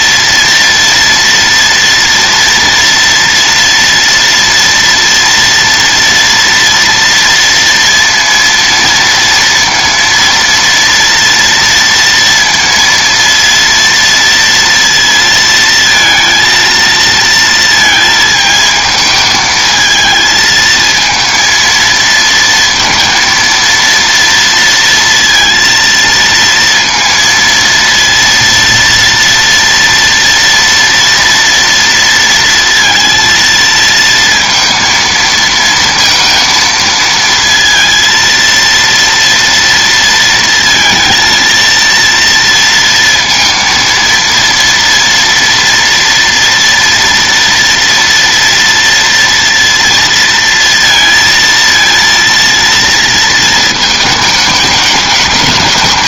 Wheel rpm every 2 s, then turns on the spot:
230, 230, 230, 230, 230, 240, 230, 230, 230, 220, 220, 230, 230, 230, 230, 230, 230, 230, 230, 230, 220, 230, 230, 230, 230, 230, 230, 210.
none